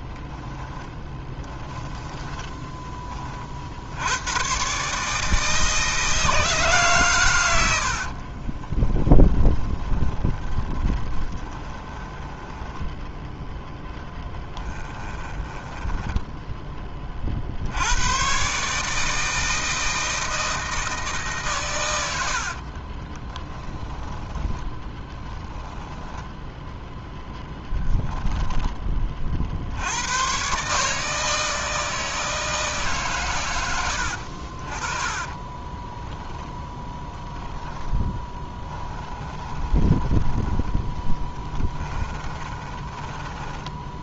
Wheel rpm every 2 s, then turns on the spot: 10, 20, 140, 140, 20, 20, 10, 10, 20, 150, 160, 30, 10, 0, 30, 150, 150, 30, 0, 10, 20, 20.
0-2 8-16 22-26 34-36 38-40 42-44